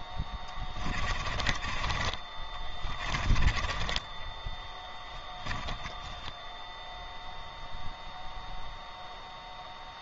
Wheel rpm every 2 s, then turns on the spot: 20, 30, 10, 10, 0.
0-6